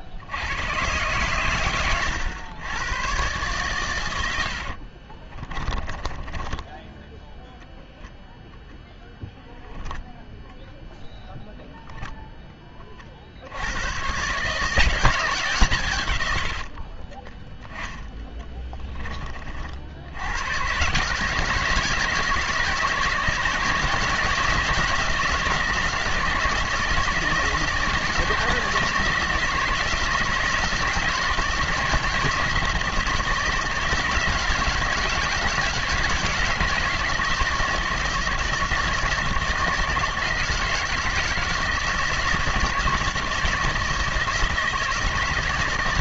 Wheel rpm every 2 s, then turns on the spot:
100, 100, 70, 10, 0, 0, 10, 150, 80, 20, 120, 160, 170, 160, 160, 160, 160, 160, 160, 160, 160, 160, 160.
4-8 18-20